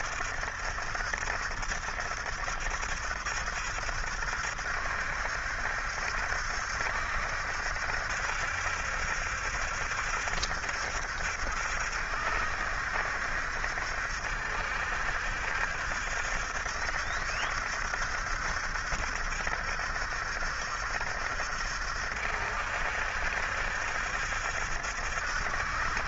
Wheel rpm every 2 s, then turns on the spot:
70, 70, 70, 70, 70, 70, 70, 70, 70, 70, 70, 70, 70.
none